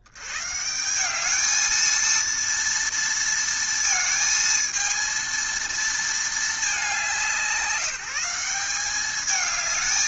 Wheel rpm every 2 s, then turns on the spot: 60, 230, 220, 220, 190.
none